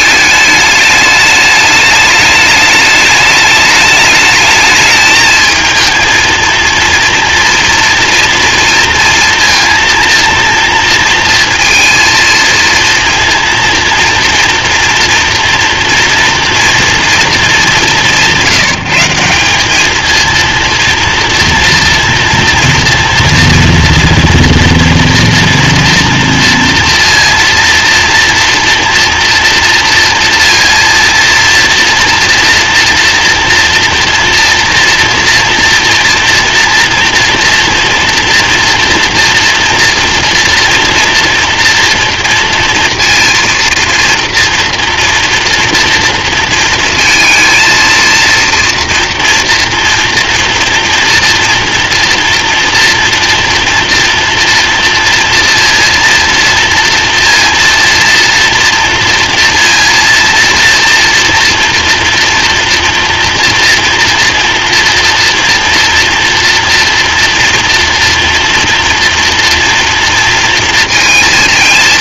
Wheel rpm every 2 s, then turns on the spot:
210, 210, 220, 230, 230, 230, 230, 230, 230, 170, 230, 230, 240, 230, 230, 230, 230, 240, 230, 230, 240, 230, 230, 230, 230, 230, 240, 240, 240, 230, 240, 230, 230, 230, 230, 230.
none